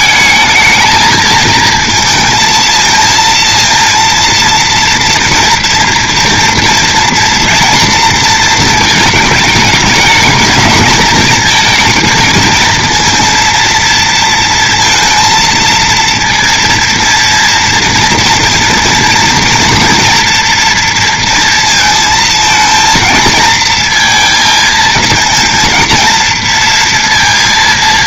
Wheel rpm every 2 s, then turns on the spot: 220, 220, 230, 230, 230, 220, 220, 230, 230, 230, 230, 230, 230, 230.
none